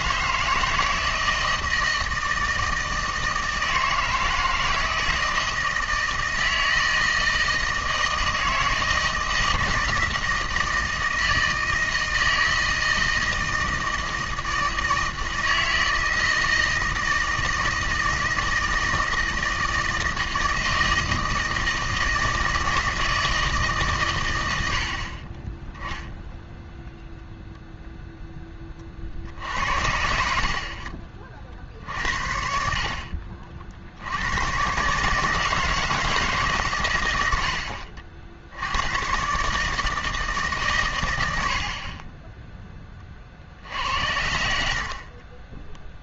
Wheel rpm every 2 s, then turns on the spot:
160, 160, 160, 160, 160, 160, 160, 160, 160, 160, 160, 160, 80, 0, 20, 50, 50, 120, 140, 90, 130, 10, 60.
none